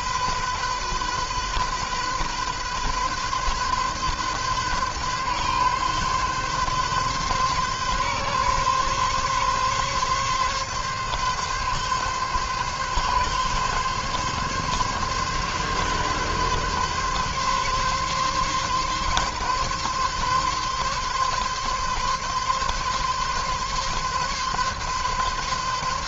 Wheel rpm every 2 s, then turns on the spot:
130, 130, 140, 140, 140, 130, 140, 140, 140, 140, 140, 140, 140.
none